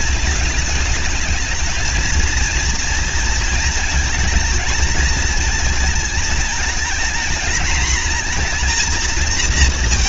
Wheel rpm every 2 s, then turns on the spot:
220, 230, 230, 220, 240.
none